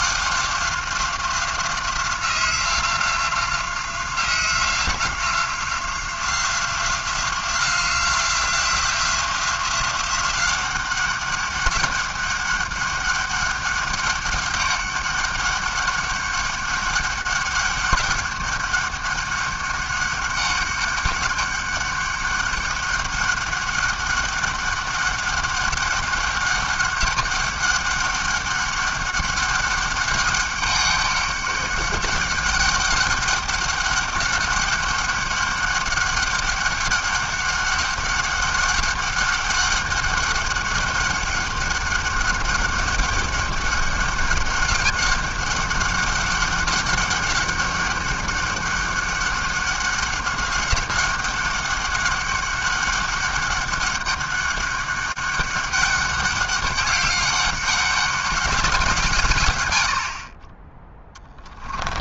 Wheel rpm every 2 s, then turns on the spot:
180, 180, 180, 180, 180, 190, 200, 200, 200, 200, 200, 200, 200, 200, 200, 200, 200, 200, 200, 200, 200, 200, 200, 200, 200, 190, 200, 200, 200, 190, 30.
none